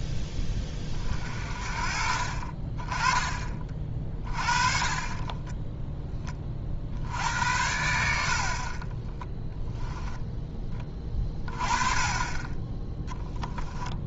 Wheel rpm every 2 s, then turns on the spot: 30, 30, 30, 50, 30, 20, 20.
4-6